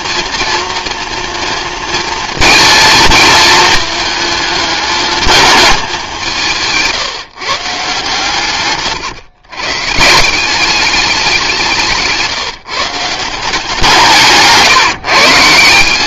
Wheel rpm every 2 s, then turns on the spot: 230, 230, 220, 160, 130, 190, 160, 150.
8-10